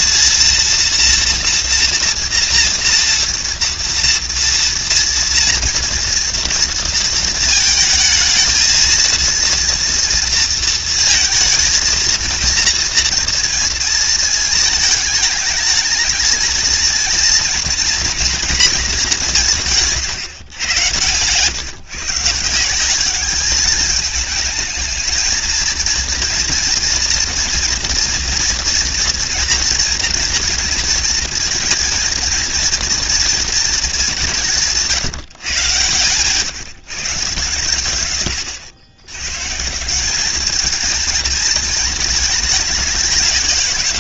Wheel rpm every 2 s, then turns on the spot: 230, 230, 230, 230, 220, 220, 230, 220, 230, 210, 130, 200, 220, 230, 240, 230, 230, 150, 150, 120, 220, 200.
20-22